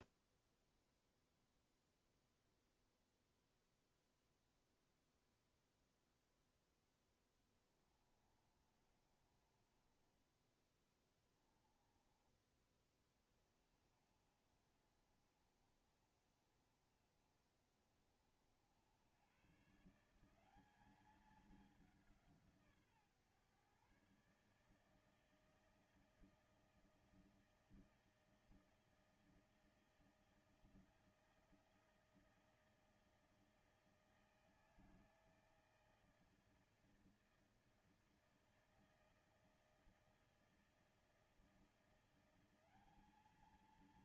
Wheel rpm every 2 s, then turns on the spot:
0, 0, 0, 0, 30, 10, 20, 40, 40, 80, 190, 150, 150, 160, 160, 160, 160, 160, 160, 160, 160, 200.
8-12